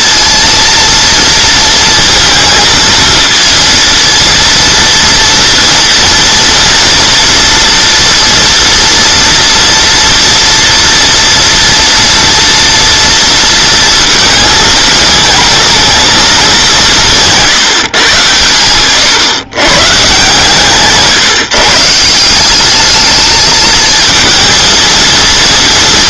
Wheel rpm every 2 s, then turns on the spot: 230, 230, 230, 230, 240, 240, 240, 220, 190, 110, 140, 200, 230.
none